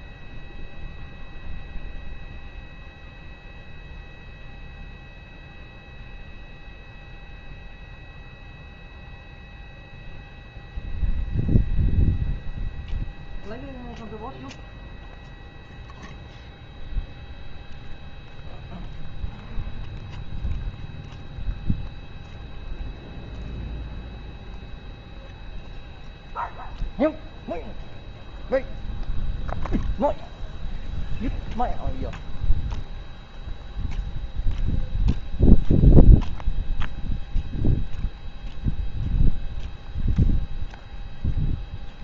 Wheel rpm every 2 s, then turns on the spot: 0, 0, 0, 0, 0, 0, 0, 0, 0, 0, 0, 0, 0, 0, 0, 0, 0, 0, 0, 0, 0.
none